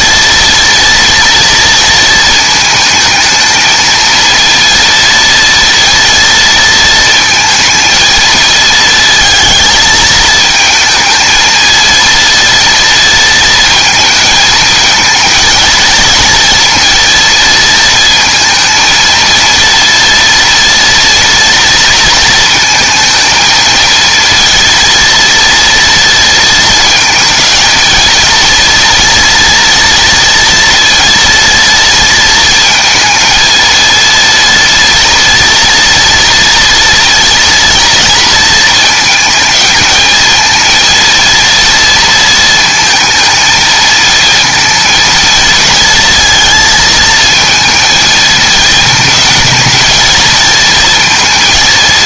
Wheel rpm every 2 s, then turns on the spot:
230, 220, 230, 230, 230, 220, 230, 220, 230, 230, 230, 220, 230, 230, 230, 230, 220, 230, 230, 230, 230, 230, 230, 230, 220, 230.
none